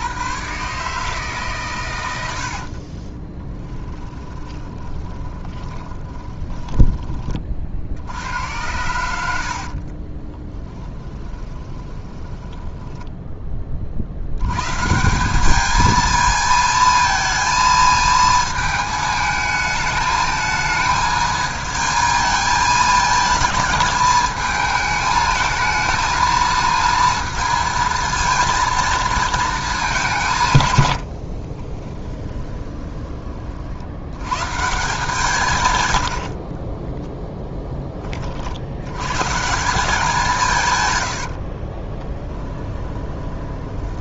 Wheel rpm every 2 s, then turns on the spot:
140, 40, 20, 20, 90, 10, 10, 130, 220, 220, 220, 220, 220, 230, 230, 100, 20, 160, 20, 70, 130, 20.
2-8 10-14 36-38 42-44